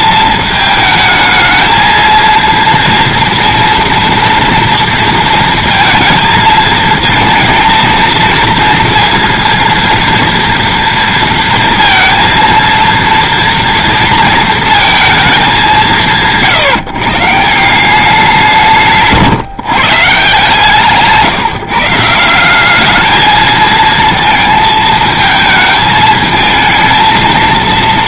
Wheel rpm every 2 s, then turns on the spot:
220, 230, 230, 220, 230, 230, 230, 230, 140, 180, 150, 180, 220, 220.
none